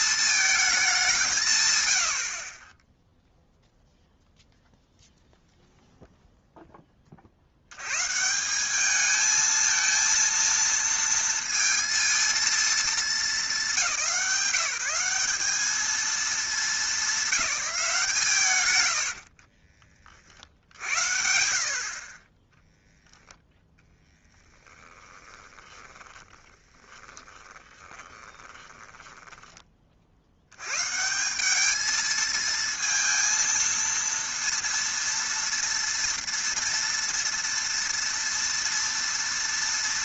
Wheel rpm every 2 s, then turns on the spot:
200, 10, 0, 30, 220, 230, 210, 190, 190, 90, 80, 0, 20, 20, 10, 150, 230, 230, 230, 230.
24-30